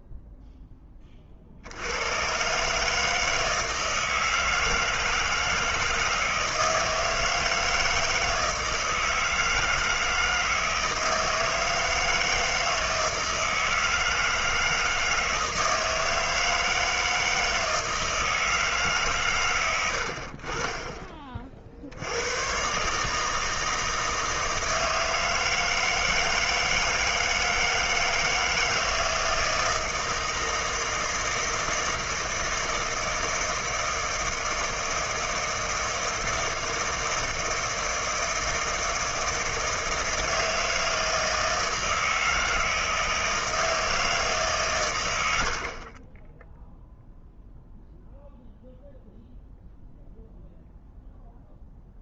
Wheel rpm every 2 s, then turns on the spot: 10, 140, 160, 160, 160, 160, 160, 160, 160, 150, 30, 130, 160, 160, 160, 160, 160, 160, 160, 160, 160, 160, 140, 0, 0, 0.
none